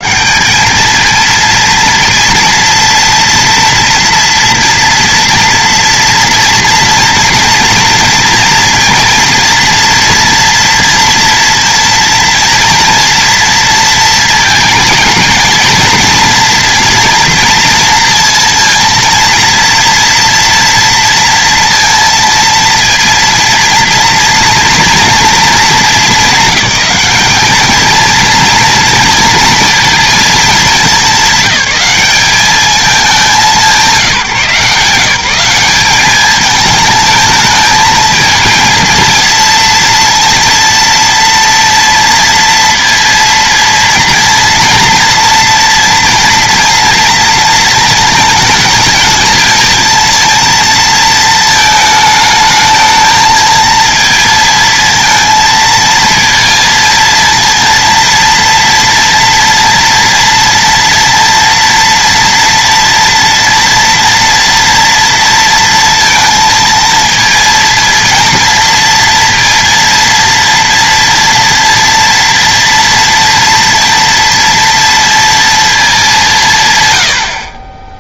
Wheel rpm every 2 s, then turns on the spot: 200, 230, 240, 230, 230, 230, 230, 220, 240, 230, 230, 230, 230, 210, 230, 210, 210, 160, 220, 220, 230, 230, 230, 230, 220, 230, 220, 230, 230, 230, 230, 230, 230, 230, 230, 230, 230, 230, 170.
none